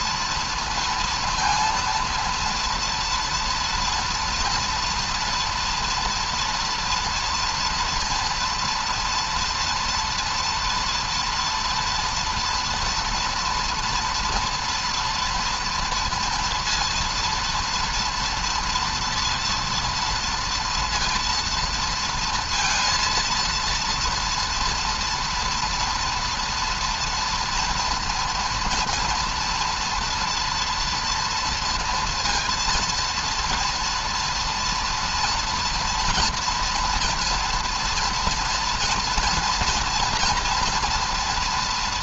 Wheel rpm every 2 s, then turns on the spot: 230, 230, 240, 230, 230, 230, 240, 240, 230, 230, 230, 230, 230, 240, 230, 230, 230, 230, 230, 230, 230.
none